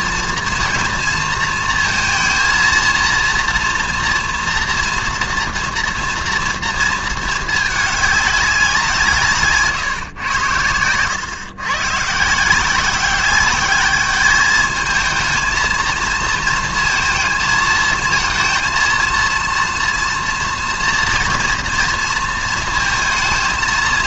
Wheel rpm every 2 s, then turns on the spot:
230, 230, 230, 230, 200, 100, 160, 210, 230, 230, 230, 230.
none